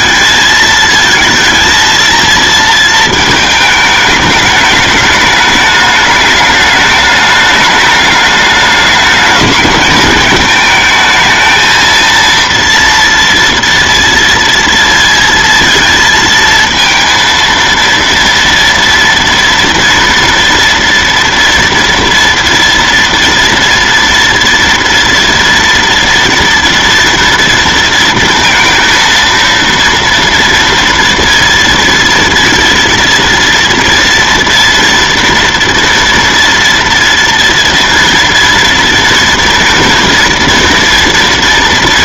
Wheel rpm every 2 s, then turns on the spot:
220, 230, 210, 210, 210, 220, 230, 230, 230, 230, 230, 230, 230, 230, 230, 230, 230, 230, 230, 230, 240.
none